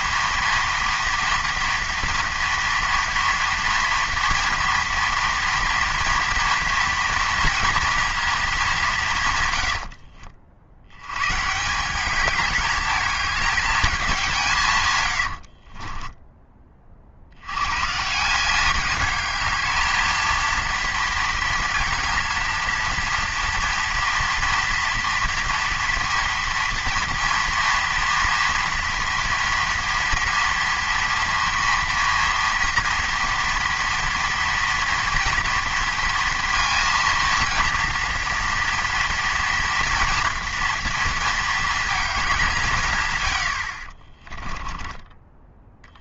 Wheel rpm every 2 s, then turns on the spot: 240, 240, 230, 230, 200, 80, 210, 140, 30, 200, 230, 230, 230, 230, 230, 230, 230, 230, 230, 230, 230, 160, 20.
44-46